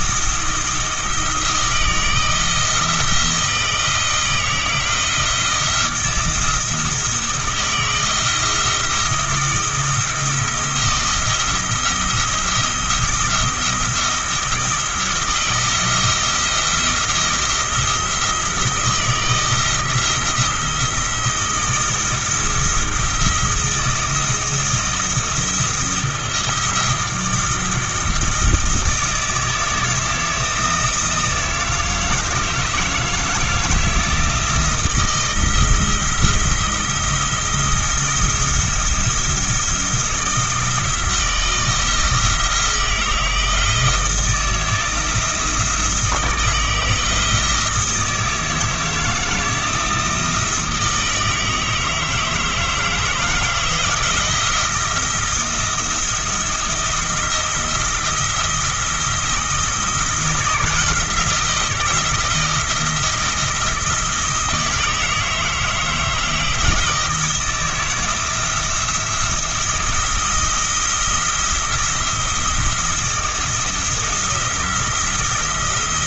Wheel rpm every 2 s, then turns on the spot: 170, 170, 170, 170, 170, 170, 170, 160, 170, 170, 170, 160, 170, 170, 170, 160, 160, 160, 170, 170, 160, 160, 170, 160, 160, 160, 160, 170, 170, 170, 170, 170, 160, 160, 170, 170, 160, 160.
none